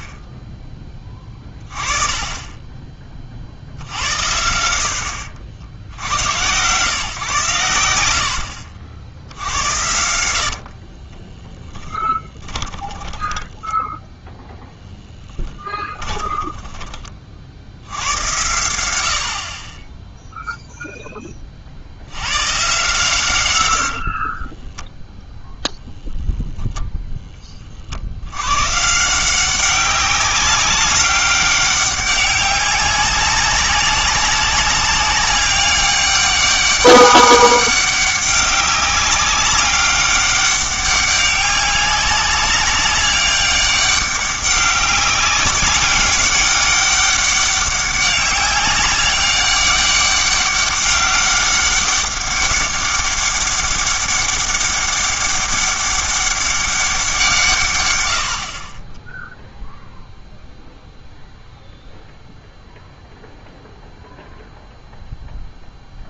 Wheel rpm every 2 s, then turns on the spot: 10, 20, 70, 130, 60, 60, 20, 0, 20, 80, 0, 130, 10, 0, 130, 200, 190, 200, 200, 200, 200, 190, 200, 200, 200, 200, 200, 200, 190, 20, 0, 0, 0.
10-14 16-18 24-26